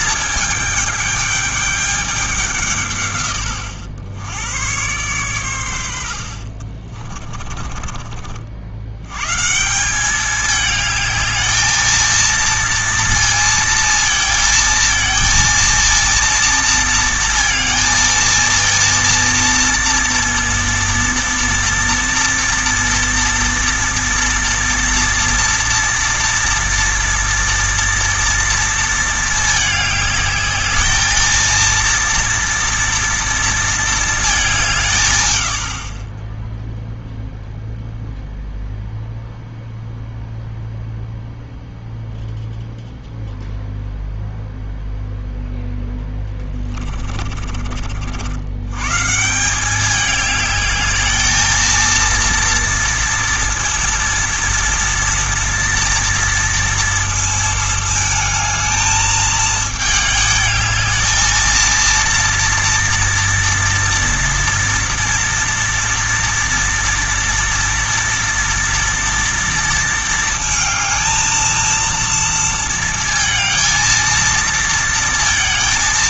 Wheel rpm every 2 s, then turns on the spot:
210, 160, 110, 40, 80, 210, 230, 220, 230, 230, 230, 230, 240, 240, 230, 220, 230, 160, 0, 0, 0, 0, 0, 20, 120, 210, 230, 230, 230, 220, 220, 230, 230, 240, 230, 220, 220, 230.
6-8 46-48